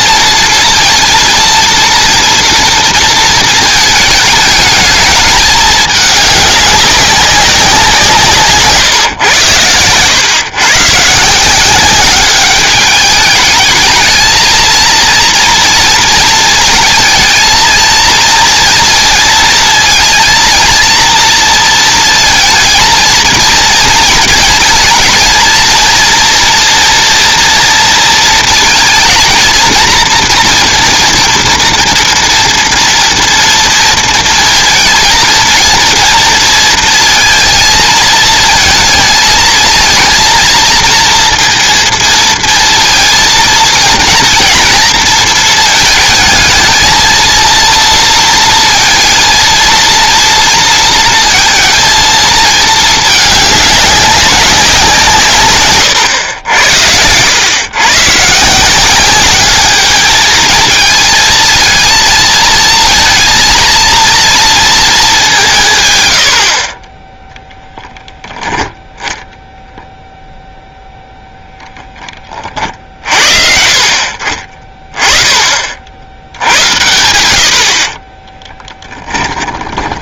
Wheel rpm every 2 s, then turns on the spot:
230, 230, 210, 200, 150, 120, 200, 230, 230, 230, 230, 230, 230, 240, 220, 230, 230, 220, 230, 220, 230, 230, 230, 220, 230, 230, 220, 180, 100, 170, 220, 230, 230, 40, 0, 0, 40, 30, 100, 10.
78-80